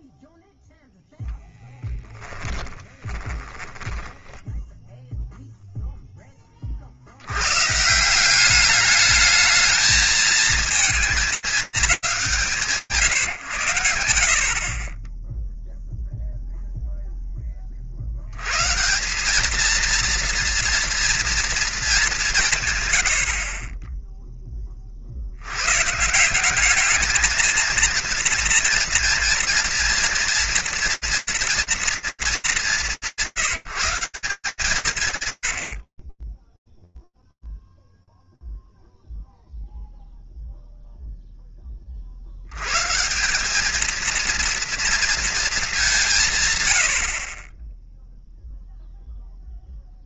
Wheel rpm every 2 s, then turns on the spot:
0, 10, 20, 30, 200, 230, 170, 50, 0, 110, 230, 140, 30, 200, 230, 230, 210, 140, 10, 0, 0, 120, 230, 90, 0.
2-6